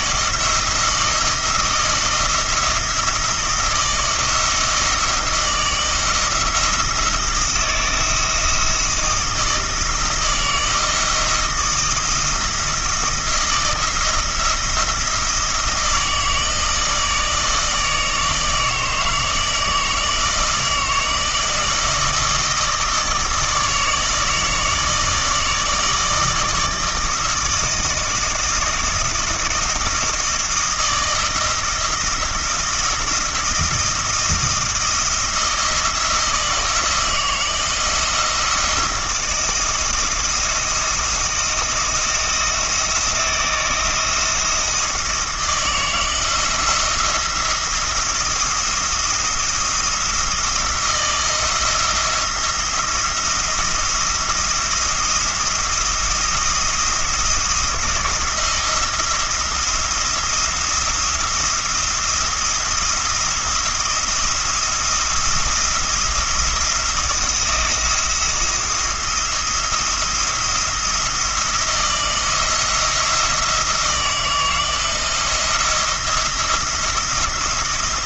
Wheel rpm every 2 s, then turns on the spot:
170, 170, 160, 160, 160, 160, 160, 170, 160, 160, 160, 160, 160, 160, 170, 170, 170, 170, 160, 160, 170, 170, 160, 170, 170, 160, 170, 170, 170, 170, 170, 170, 170, 170, 170, 170, 170, 170, 170.
none